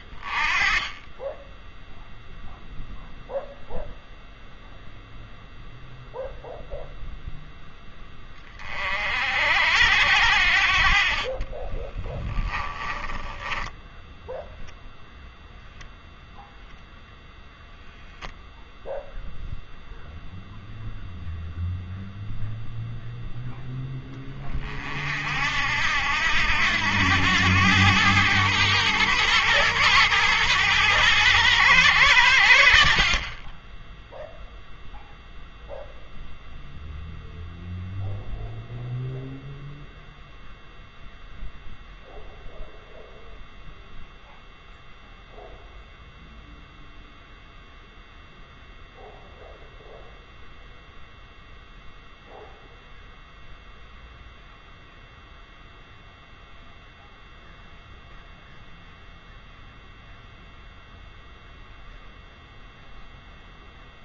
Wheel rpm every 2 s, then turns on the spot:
20, 0, 0, 0, 40, 60, 10, 0, 0, 0, 0, 0, 30, 90, 110, 110, 70, 0, 0, 0, 0, 0, 0, 0, 0, 0, 0, 0, 0, 0, 0, 0.
12-14